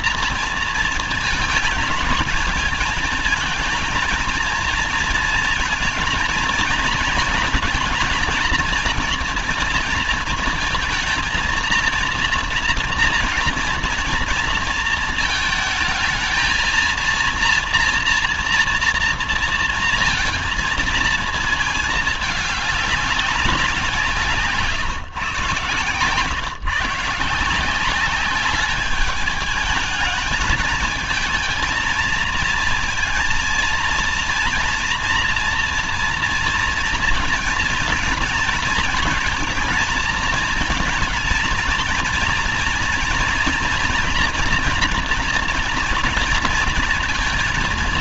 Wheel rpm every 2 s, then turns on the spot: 240, 220, 230, 230, 230, 220, 230, 230, 230, 230, 230, 210, 150, 130, 200, 220, 230, 230, 230, 230, 230, 230, 240, 230.
none